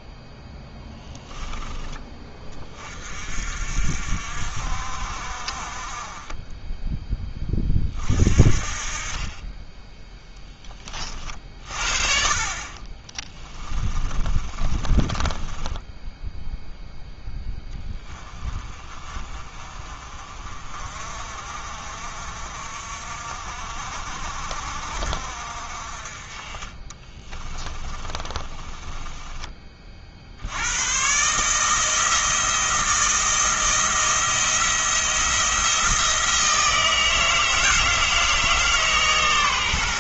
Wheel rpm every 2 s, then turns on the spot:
0, 30, 60, 20, 40, 30, 40, 30, 0, 30, 40, 50, 50, 40, 20, 100, 170, 170, 160, 150.
14-16 28-30